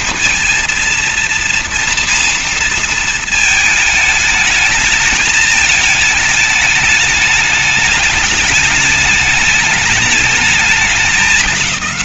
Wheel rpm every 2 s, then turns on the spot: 230, 230, 220, 210, 210, 210.
none